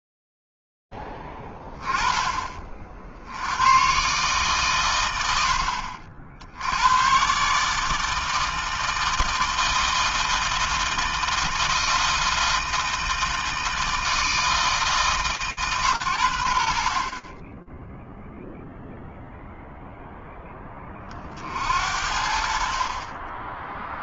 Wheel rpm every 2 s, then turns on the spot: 0, 30, 140, 80, 160, 160, 160, 150, 80, 0, 20, 40.
none